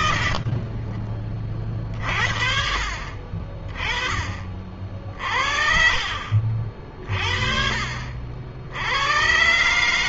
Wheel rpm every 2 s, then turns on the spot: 30, 40, 40, 40, 90.
4-6